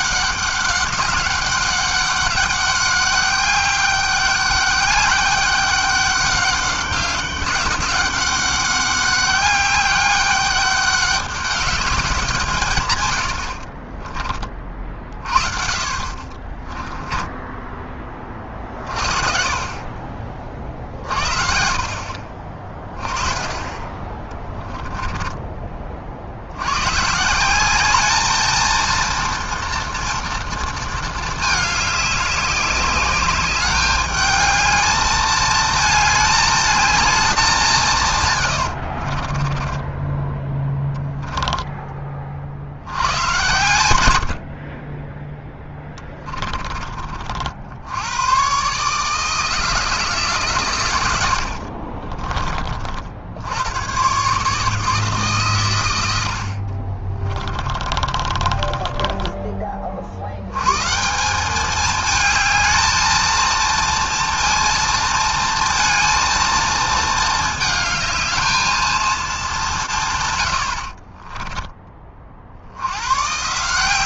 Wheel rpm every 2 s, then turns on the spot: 200, 200, 200, 200, 200, 200, 150, 40, 30, 30, 30, 30, 20, 90, 220, 230, 200, 210, 210, 110, 10, 60, 60, 20, 120, 140, 40, 140, 50, 20, 100, 220, 230, 220, 220, 90, 60.
16-18 24-26 38-42 46-48 58-60